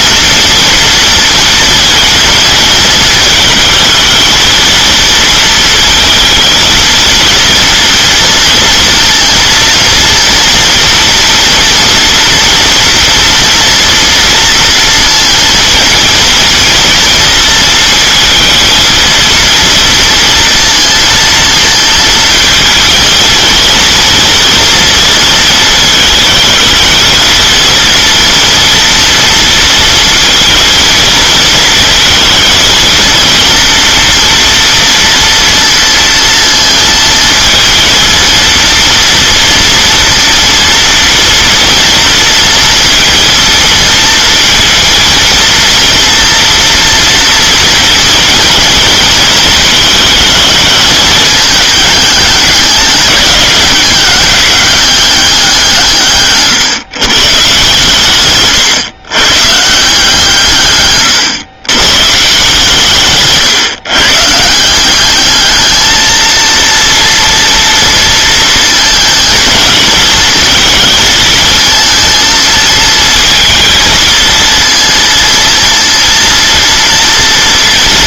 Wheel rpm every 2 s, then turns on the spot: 230, 220, 230, 230, 230, 230, 230, 230, 230, 230, 230, 230, 230, 220, 230, 230, 230, 230, 220, 230, 230, 230, 230, 240, 230, 210, 200, 200, 140, 120, 120, 140, 200, 230, 220, 220, 230, 230, 240.
60-62